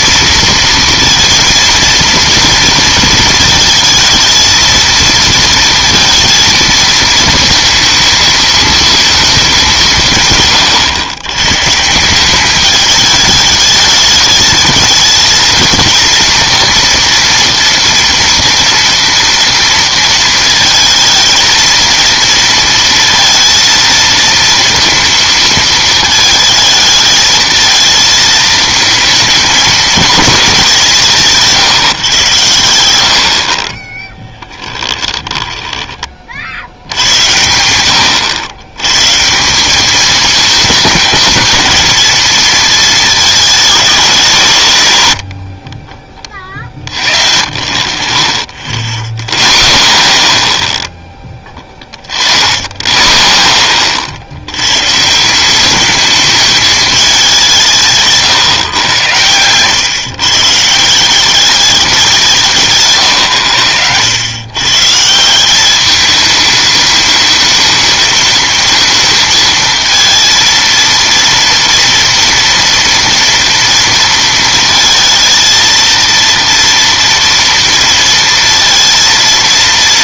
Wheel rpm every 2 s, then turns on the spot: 230, 230, 230, 220, 220, 110, 210, 220, 230, 230, 220, 220, 230, 220, 230, 170, 70, 20, 80, 110, 220, 220, 120, 40, 0, 0, 30, 100, 210, 120, 150, 150, 120, 220, 220, 230, 230, 230, 230, 230.
34-36